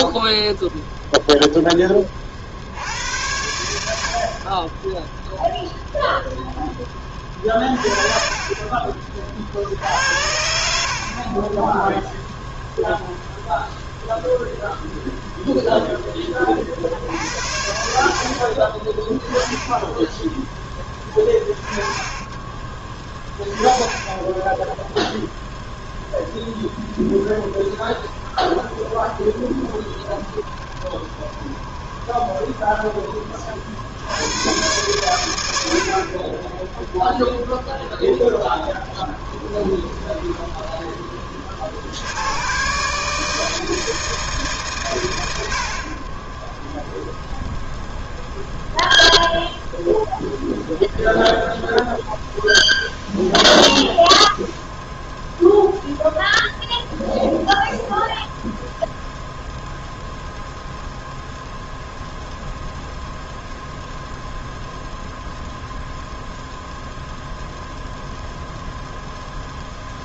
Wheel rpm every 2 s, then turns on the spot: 0, 70, 10, 10, 30, 60, 0, 0, 50, 30, 10, 20, 0, 0, 20, 20, 10, 110, 0, 10, 10, 140, 120, 0, 0, 0, 0, 0, 0, 0, 0, 0, 0, 0, 0.
8-10 28-32 38-42